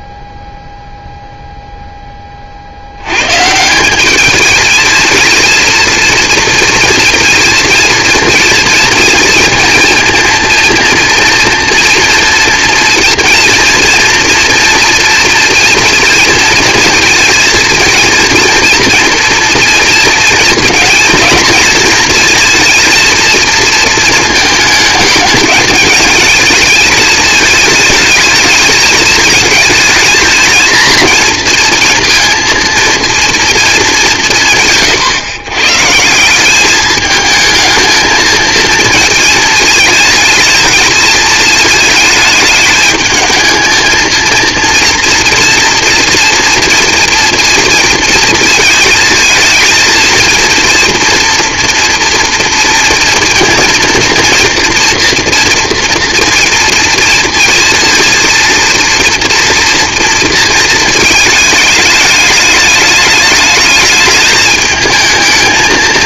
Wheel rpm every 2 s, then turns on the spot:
0, 60, 210, 230, 230, 230, 230, 230, 230, 230, 230, 230, 210, 220, 220, 220, 230, 150, 200, 230, 220, 220, 230, 240, 230, 230, 230, 240, 230, 230, 230, 210, 220.
none